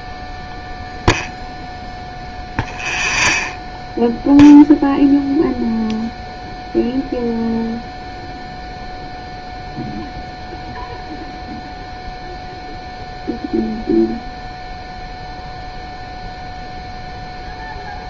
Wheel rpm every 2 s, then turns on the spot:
0, 0, 0, 0, 0, 0, 0, 0, 0.
none